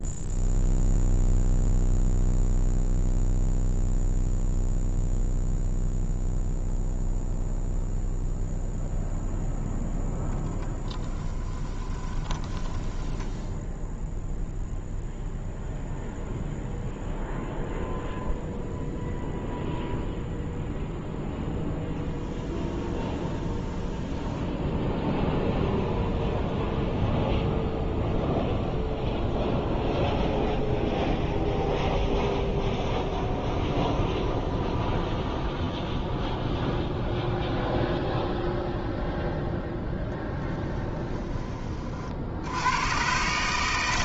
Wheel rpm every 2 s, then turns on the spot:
0, 0, 0, 0, 0, 10, 10, 0, 0, 0, 0, 0, 0, 0, 0, 0, 0, 0, 0, 0, 20, 120.
10-14 40-42